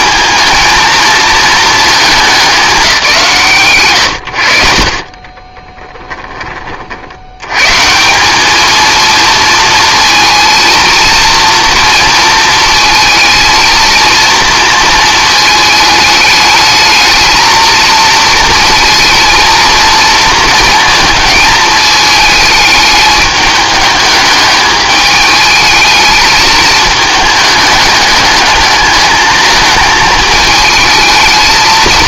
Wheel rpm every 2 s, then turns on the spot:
220, 140, 30, 70, 230, 230, 220, 220, 220, 230, 220, 210, 210, 210, 220, 220.
4-6